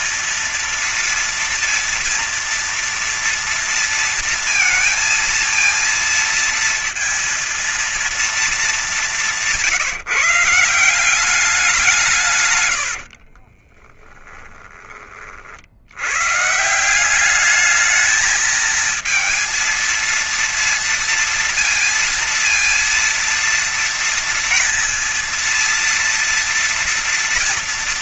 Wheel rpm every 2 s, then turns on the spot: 230, 230, 230, 230, 230, 180, 140, 20, 140, 220, 230, 230, 230, 230.
12-14